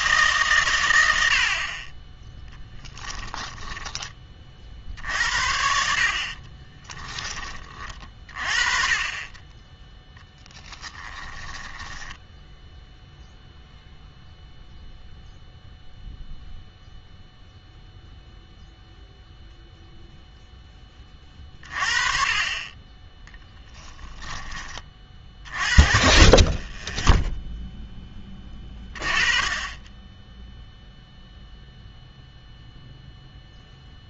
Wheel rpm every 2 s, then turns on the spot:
130, 10, 50, 20, 30, 10, 0, 0, 0, 0, 10, 20, 20, 30, 20, 0, 0.
2-4 6-12